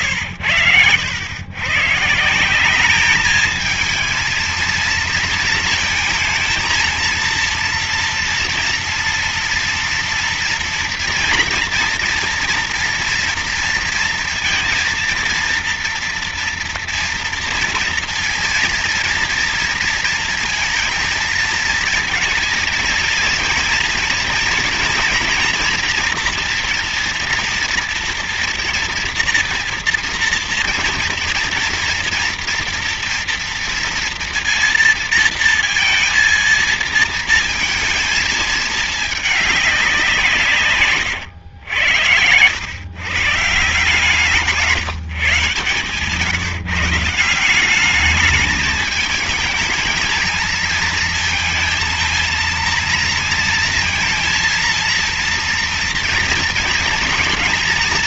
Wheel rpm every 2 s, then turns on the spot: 100, 180, 230, 220, 230, 230, 240, 230, 230, 230, 230, 230, 230, 240, 230, 240, 230, 230, 230, 220, 140, 100, 160, 160, 210, 230, 230, 230, 230.
none